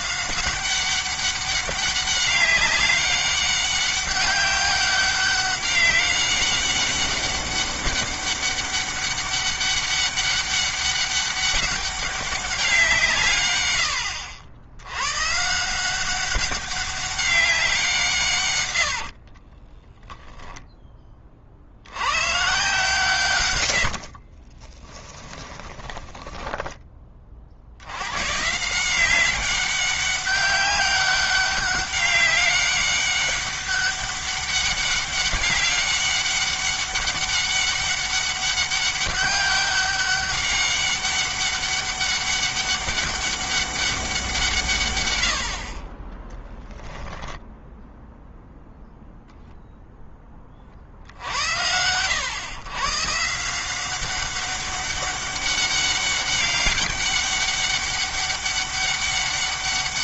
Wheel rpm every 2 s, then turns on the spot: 190, 200, 200, 200, 200, 200, 170, 100, 200, 70, 20, 140, 20, 30, 180, 200, 200, 200, 200, 200, 200, 200, 110, 0, 0, 60, 140, 200, 200, 200.
18-20 24-26 44-46